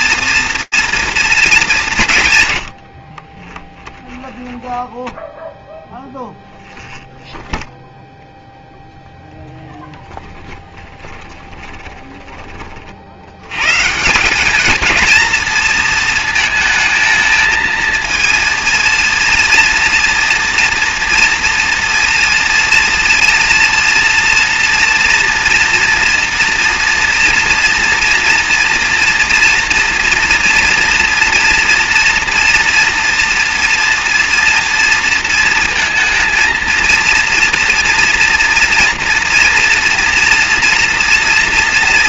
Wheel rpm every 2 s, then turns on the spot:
220, 30, 0, 0, 0, 20, 70, 230, 220, 230, 230, 230, 240, 230, 230, 230, 230, 230, 230, 240, 240.
2-4 10-12